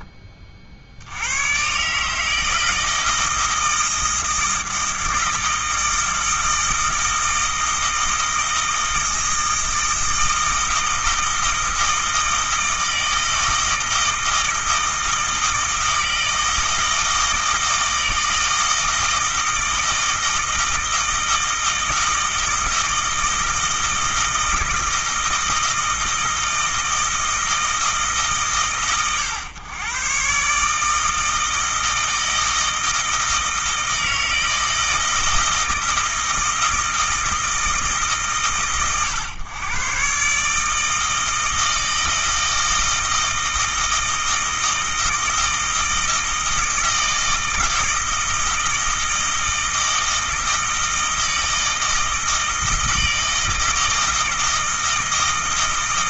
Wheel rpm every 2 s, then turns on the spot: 50, 160, 160, 160, 160, 160, 160, 160, 160, 160, 160, 160, 160, 160, 130, 150, 160, 160, 160, 120, 150, 160, 160, 160, 160, 160, 160, 160.
none